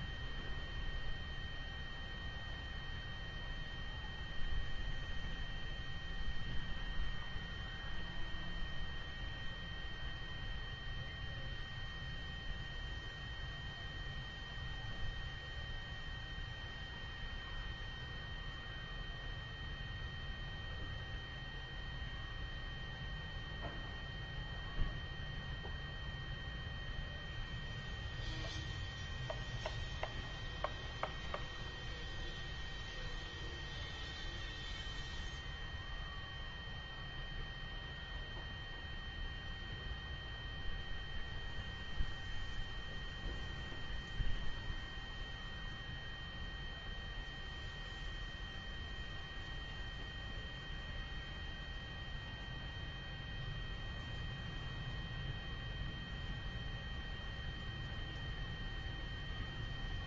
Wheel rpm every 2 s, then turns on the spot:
0, 0, 0, 0, 0, 0, 0, 0, 0, 0, 0, 0, 0, 0, 0, 0, 0, 0, 0, 0, 0, 0, 0, 0, 0, 0, 0, 0, 0, 0.
none